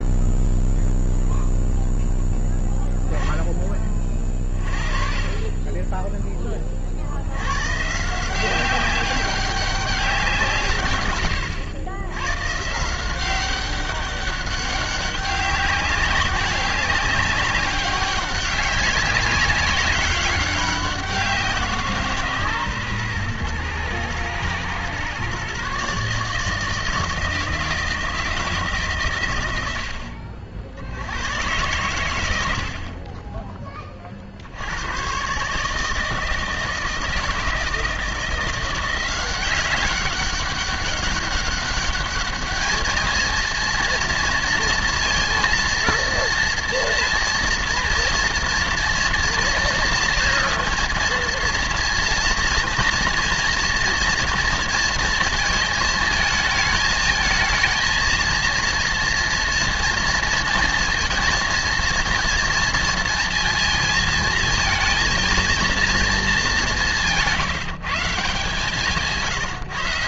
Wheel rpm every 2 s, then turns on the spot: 0, 0, 40, 30, 190, 140, 150, 200, 200, 190, 190, 130, 120, 160, 150, 60, 70, 90, 160, 170, 200, 210, 230, 230, 240, 230, 230, 230, 220, 230, 230, 230, 230, 200, 150.
68-70